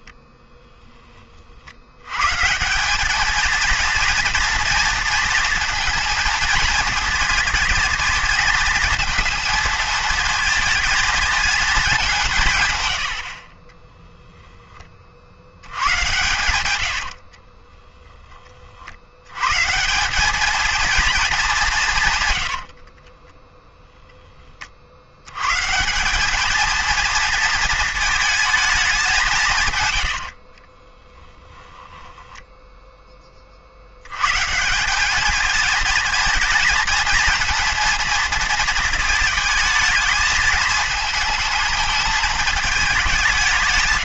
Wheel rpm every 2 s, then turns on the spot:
0, 170, 230, 230, 230, 220, 120, 10, 90, 40, 220, 70, 30, 220, 220, 50, 10, 160, 220, 230, 220, 210.
16-18 22-24 30-34